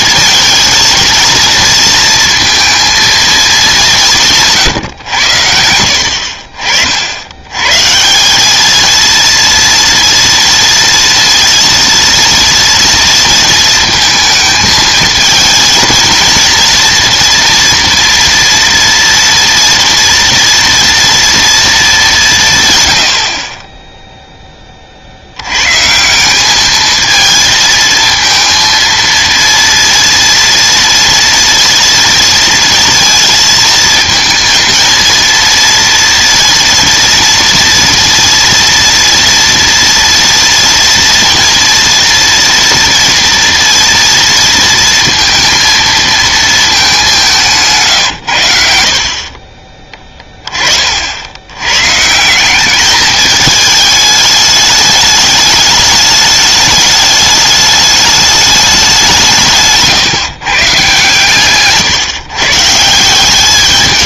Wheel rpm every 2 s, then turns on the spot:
230, 230, 150, 50, 210, 230, 230, 220, 230, 240, 230, 130, 10, 200, 230, 230, 230, 230, 230, 230, 230, 230, 230, 220, 80, 30, 180, 210, 210, 210, 140, 140.
none